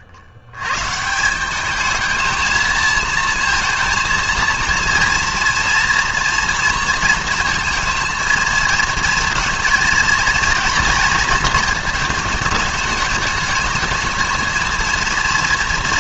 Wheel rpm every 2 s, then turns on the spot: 110, 220, 230, 230, 230, 230, 210, 230.
none